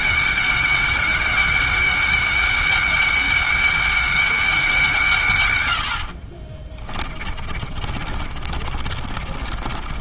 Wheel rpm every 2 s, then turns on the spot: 200, 200, 170, 30, 40.
6-10